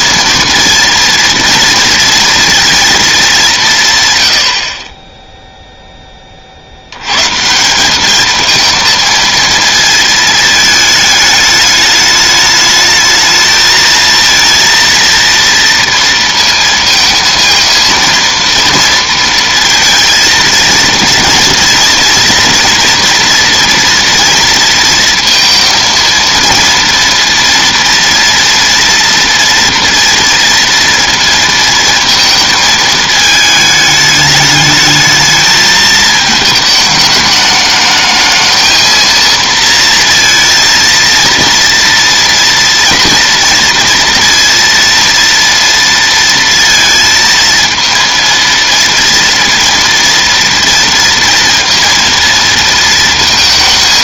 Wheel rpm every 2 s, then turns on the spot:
230, 230, 60, 50, 220, 220, 210, 230, 230, 230, 230, 230, 230, 230, 230, 230, 220, 210, 220, 220, 230, 230, 230, 230, 230, 230, 230.
none